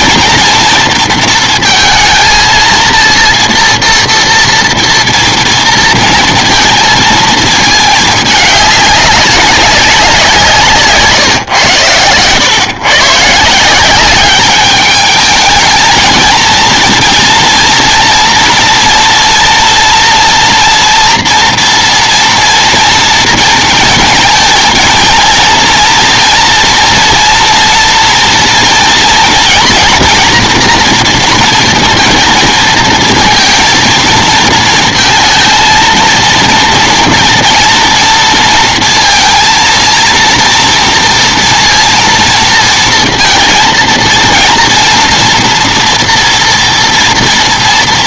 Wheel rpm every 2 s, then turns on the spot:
230, 230, 230, 230, 200, 150, 120, 210, 230, 230, 230, 230, 230, 240, 230, 230, 220, 230, 230, 230, 230, 230, 230, 230.
none